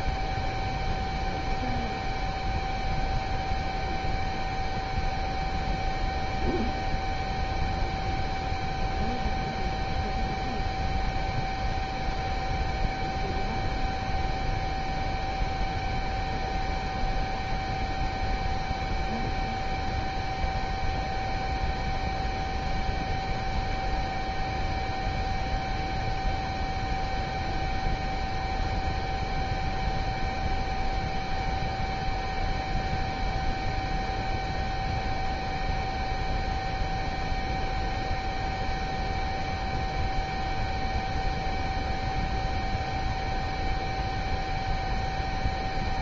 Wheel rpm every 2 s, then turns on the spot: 0, 0, 0, 0, 0, 0, 0, 0, 0, 0, 0, 0, 0, 0, 0, 0, 0, 0, 0, 0, 0, 0, 0.
none